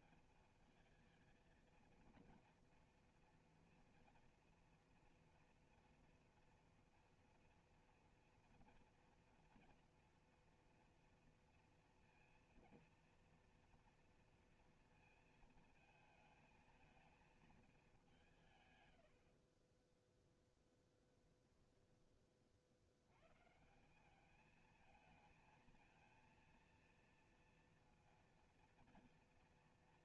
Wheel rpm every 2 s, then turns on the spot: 220, 230, 240, 240, 240, 240, 240, 230, 220, 120, 10, 70, 220, 230, 230.
20-22